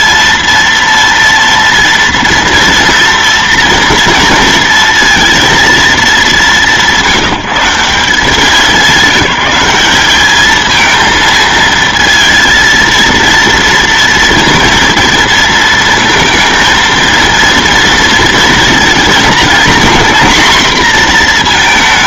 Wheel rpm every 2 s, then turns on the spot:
230, 230, 230, 190, 190, 220, 230, 230, 230, 230, 240.
none